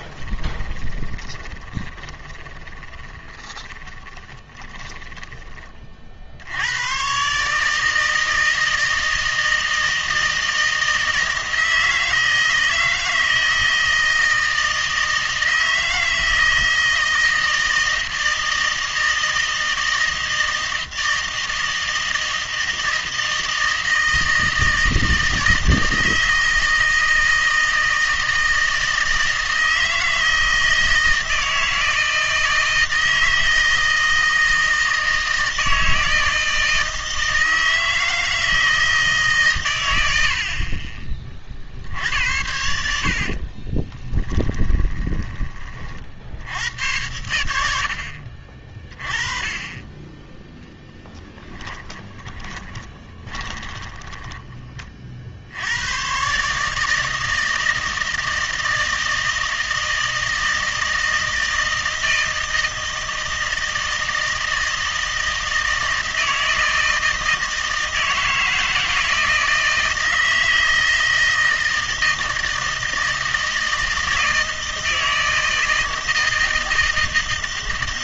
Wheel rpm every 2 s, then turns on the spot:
20, 20, 20, 90, 160, 160, 160, 160, 160, 160, 160, 160, 160, 160, 160, 160, 160, 160, 160, 160, 40, 80, 20, 90, 30, 0, 30, 20, 150, 160, 160, 160, 160, 160, 160, 160, 160, 160, 160.
0-6 42-46 52-54